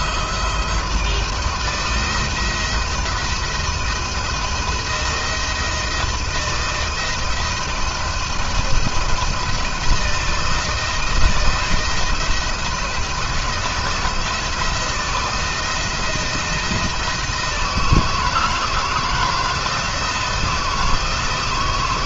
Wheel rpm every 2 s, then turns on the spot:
160, 170, 170, 170, 170, 170, 170, 170, 160, 160, 170.
none